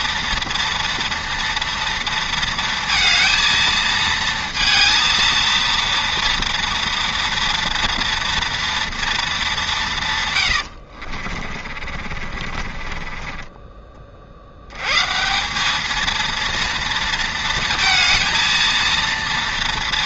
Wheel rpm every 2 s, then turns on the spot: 240, 230, 230, 230, 230, 90, 40, 80, 220, 230.
10-14